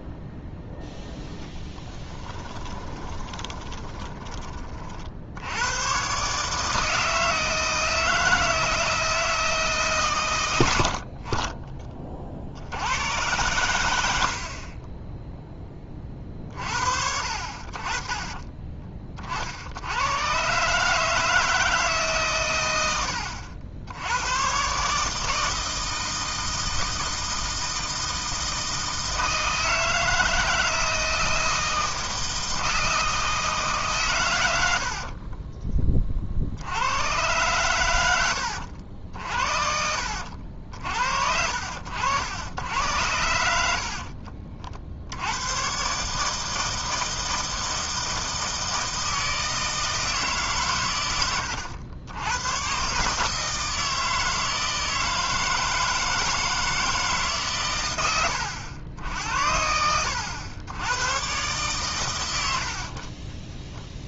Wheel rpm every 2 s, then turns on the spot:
0, 30, 40, 150, 160, 70, 80, 30, 40, 20, 150, 100, 140, 160, 160, 160, 160, 70, 90, 70, 60, 80, 60, 160, 160, 120, 130, 160, 160, 80, 90, 70.
2-4